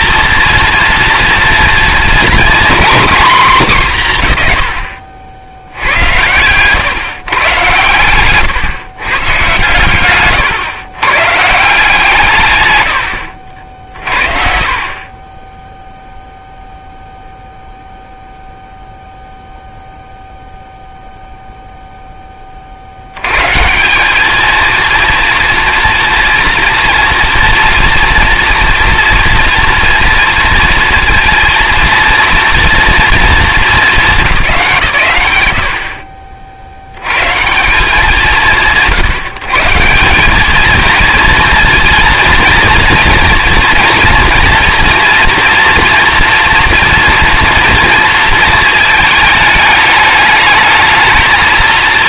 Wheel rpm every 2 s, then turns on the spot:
230, 240, 80, 120, 130, 150, 70, 20, 0, 0, 0, 60, 230, 230, 230, 230, 230, 140, 80, 110, 220, 230, 230, 230, 220, 220.
none